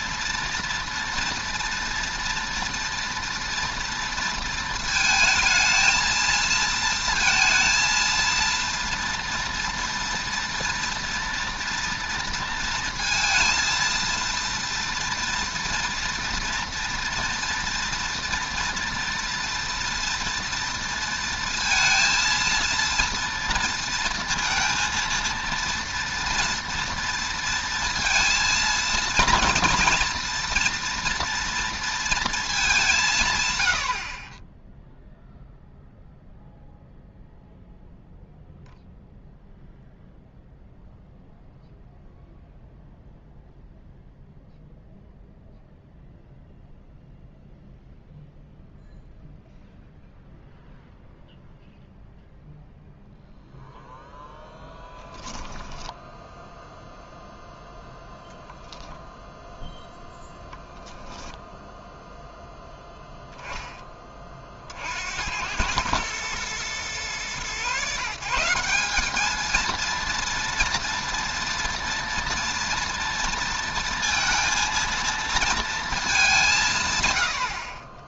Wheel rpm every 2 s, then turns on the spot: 230, 230, 230, 230, 230, 230, 220, 230, 230, 230, 230, 230, 230, 230, 230, 230, 200, 10, 0, 0, 0, 0, 0, 0, 0, 0, 0, 0, 0, 0, 0, 0, 60, 120, 180, 230, 240, 230, 150.
none